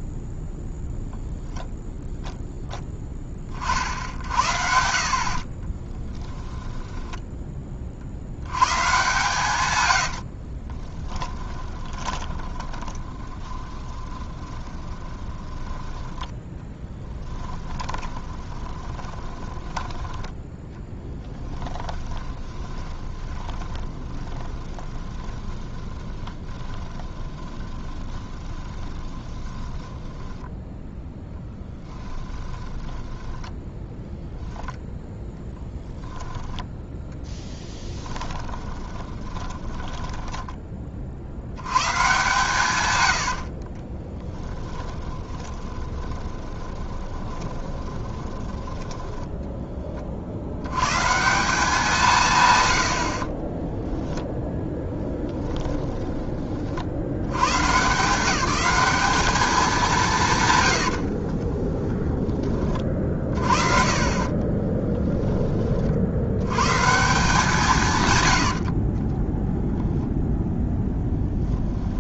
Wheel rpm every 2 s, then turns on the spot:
0, 0, 70, 20, 110, 30, 30, 20, 10, 20, 10, 20, 20, 20, 20, 10, 10, 0, 0, 10, 10, 130, 10, 20, 20, 50, 160, 0, 20, 180, 150, 20, 40, 90, 110, 0.
6-8 10-16 18-20 22-30 32-34 38-42 44-50 64-66